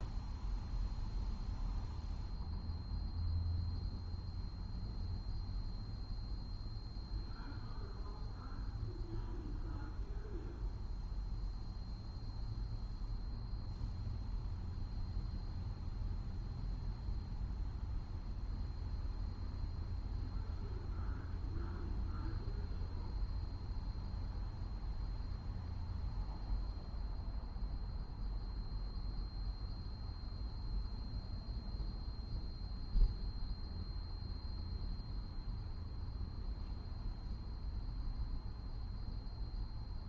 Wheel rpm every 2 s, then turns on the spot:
0, 0, 0, 0, 0, 0, 0, 0, 0, 0, 0, 0, 0, 0, 0, 0, 0, 0, 0, 0.
none